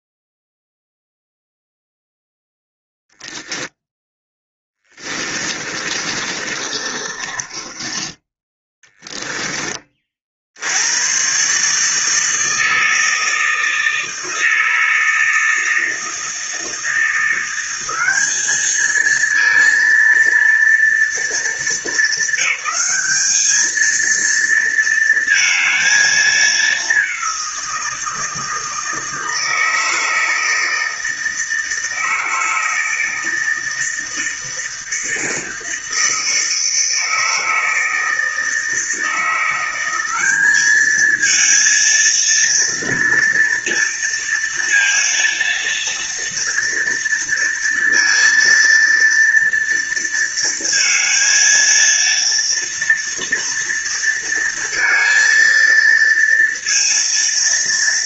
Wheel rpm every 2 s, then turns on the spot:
0, 0, 10, 30, 20, 90, 160, 160, 160, 210, 230, 200, 230, 210, 160, 160, 160, 160, 160, 160, 210, 230, 230, 230, 230, 230, 230, 230, 230.
4-8